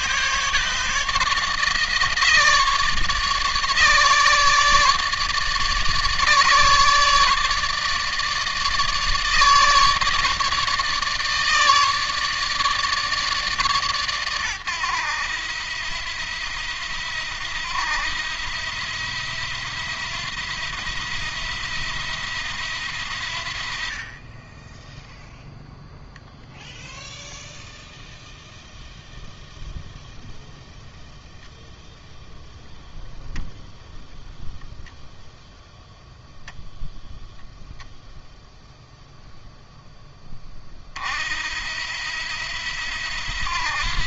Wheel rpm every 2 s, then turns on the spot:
160, 150, 150, 150, 150, 150, 150, 100, 80, 80, 80, 80, 10, 0, 0, 0, 0, 10, 0, 0, 50, 80.
none